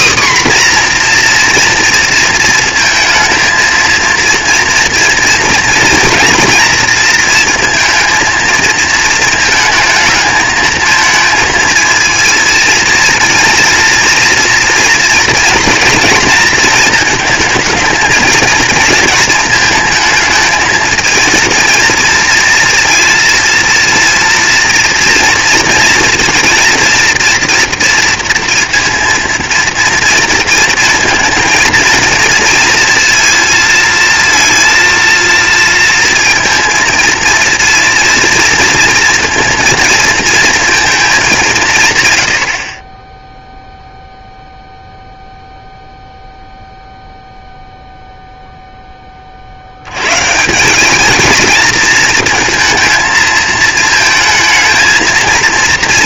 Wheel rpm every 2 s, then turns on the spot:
260, 220, 230, 230, 230, 220, 220, 230, 230, 220, 230, 230, 230, 230, 230, 230, 230, 230, 230, 230, 230, 50, 0, 0, 0, 180, 230, 230.
none